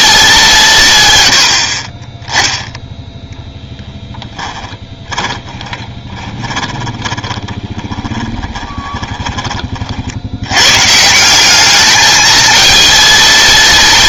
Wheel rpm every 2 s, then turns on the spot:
170, 0, 10, 20, 30, 110, 220.
4-10